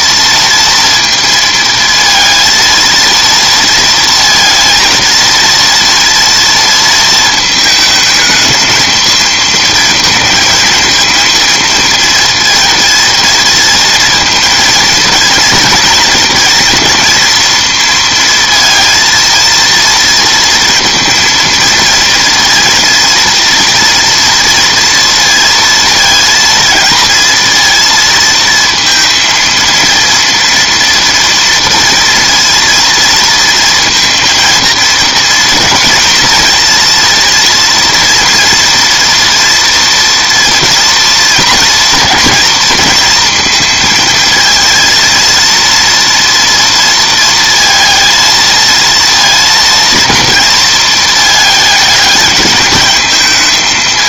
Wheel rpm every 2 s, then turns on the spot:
230, 230, 230, 230, 220, 230, 230, 220, 230, 230, 230, 230, 230, 230, 230, 240, 230, 230, 230, 240, 230, 230, 230, 230, 220, 230, 210.
none